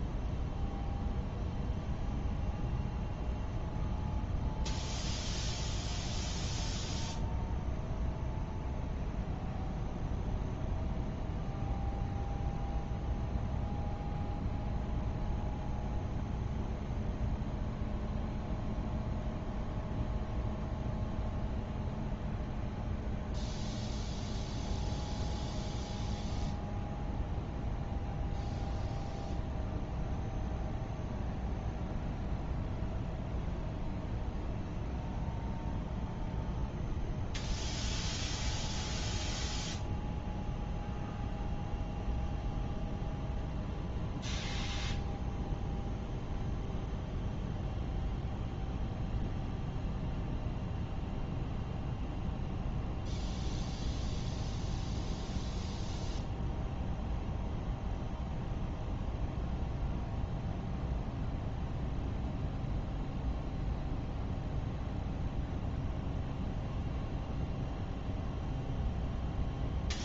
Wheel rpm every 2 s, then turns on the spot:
0, 0, 0, 0, 0, 0, 0, 0, 0, 0, 0, 0, 0, 0, 0, 0, 0, 0, 0, 0, 0, 0, 0, 0, 0, 0, 0, 0, 0, 0, 0, 0, 0, 0, 0.
none